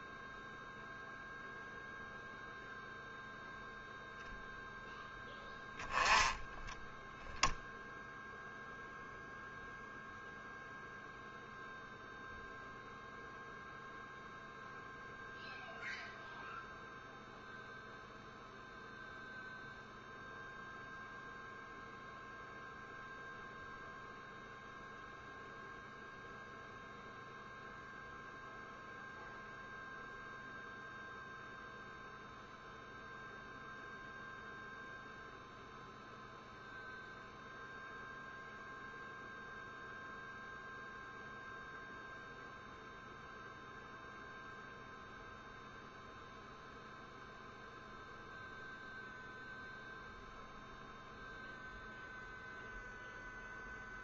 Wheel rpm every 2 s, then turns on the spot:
0, 0, 0, 0, 0, 0, 0, 0, 0, 0, 0, 0, 0, 0, 0, 0, 0, 0, 0, 0, 0, 0, 0, 0, 0, 0, 0.
none